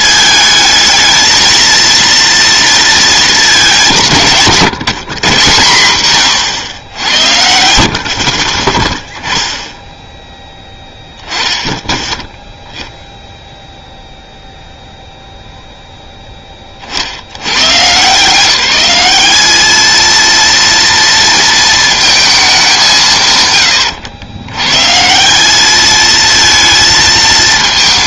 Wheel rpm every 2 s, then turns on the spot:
220, 230, 150, 110, 30, 10, 0, 0, 20, 180, 230, 210, 120, 230.
none